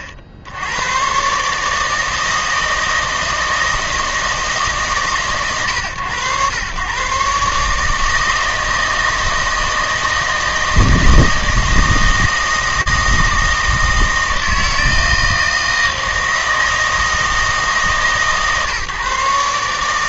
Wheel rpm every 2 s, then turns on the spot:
70, 160, 150, 110, 160, 160, 160, 160, 160, 140.
none